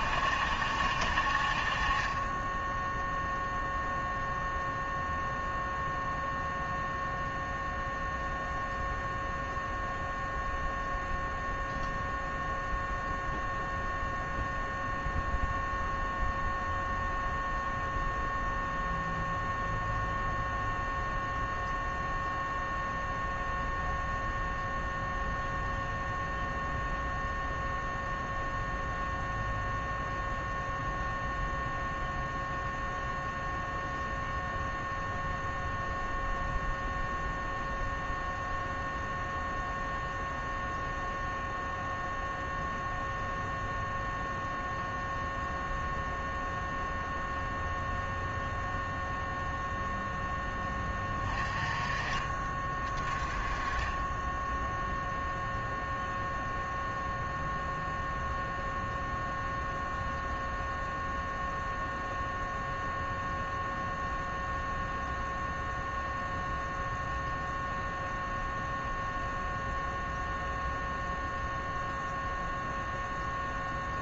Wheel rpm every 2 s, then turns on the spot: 60, 10, 0, 0, 0, 0, 0, 0, 0, 0, 0, 0, 0, 0, 0, 0, 0, 0, 0, 0, 0, 0, 0, 0, 0, 20, 30, 0, 0, 0, 0, 0, 0, 0, 0, 0, 0.
none